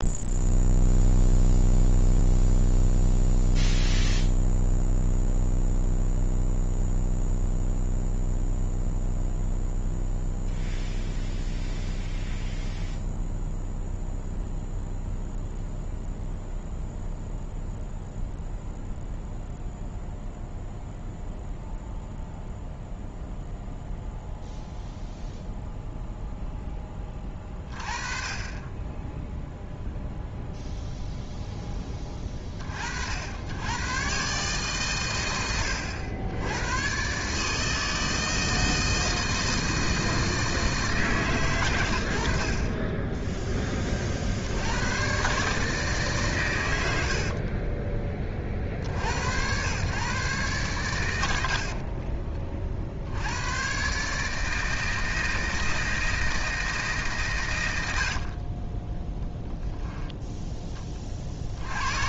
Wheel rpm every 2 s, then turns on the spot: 0, 0, 0, 0, 0, 0, 0, 0, 0, 0, 0, 0, 0, 10, 20, 0, 40, 130, 110, 160, 160, 40, 100, 100, 50, 110, 50, 160, 150, 20, 10.
58-60